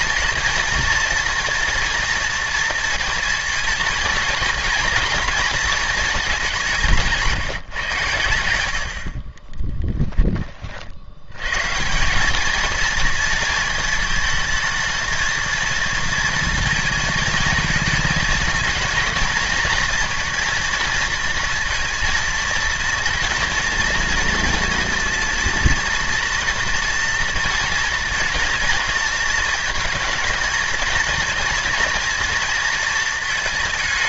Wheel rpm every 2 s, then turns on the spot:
230, 230, 230, 190, 90, 40, 220, 220, 230, 230, 230, 230, 230, 230, 220, 220, 230.
none